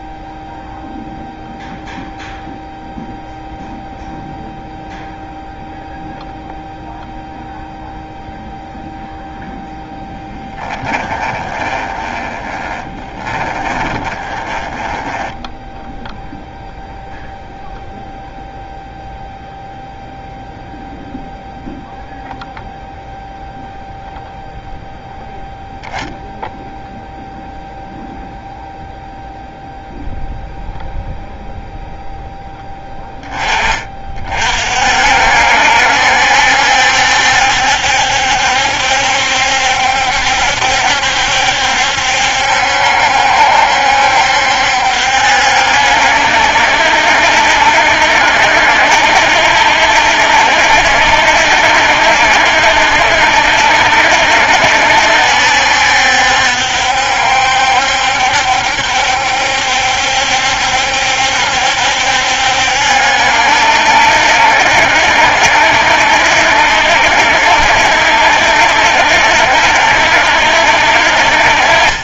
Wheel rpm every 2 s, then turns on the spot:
0, 0, 0, 0, 0, 10, 20, 10, 0, 0, 0, 0, 0, 0, 0, 0, 10, 50, 70, 70, 70, 70, 70, 70, 70, 70, 70, 70, 70, 70, 70, 70, 60, 70, 70, 60.
10-16